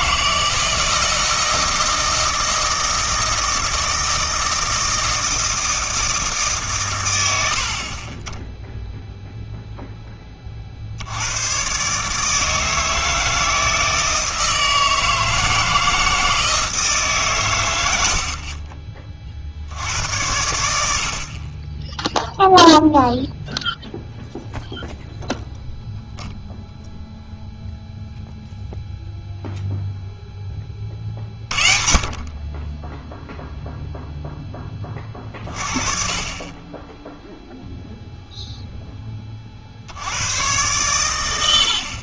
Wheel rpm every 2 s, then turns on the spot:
160, 160, 160, 120, 10, 50, 160, 160, 160, 30, 80, 0, 0, 0, 0, 30, 10, 20, 20, 10, 110.
none